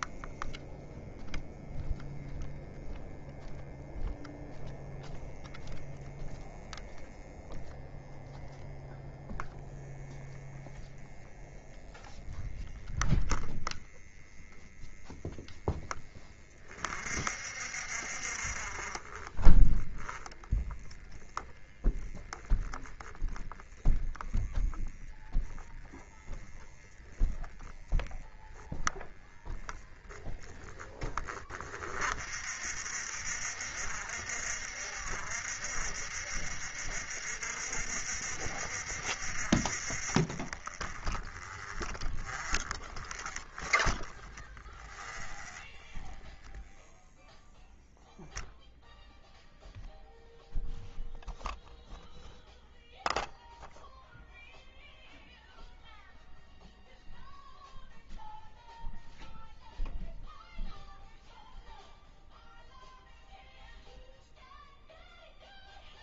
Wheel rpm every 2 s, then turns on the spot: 0, 0, 0, 0, 0, 0, 0, 0, 20, 20, 0, 0, 0, 0, 0, 0, 30, 30, 30, 30, 20, 30, 20, 0, 0, 0, 0, 0, 0, 0, 0, 0, 0.
42-46